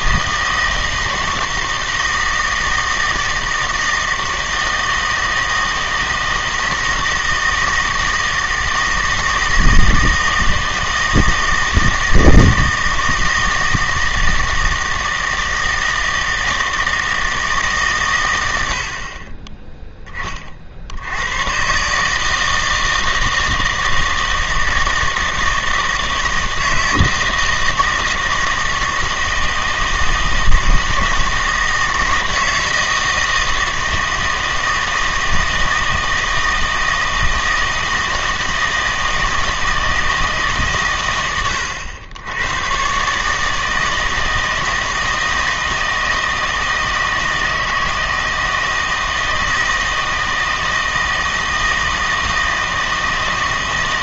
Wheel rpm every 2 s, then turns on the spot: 160, 160, 160, 160, 160, 160, 160, 160, 160, 80, 60, 160, 160, 160, 160, 160, 160, 160, 160, 160, 140, 110, 160, 160, 160, 160, 160.
none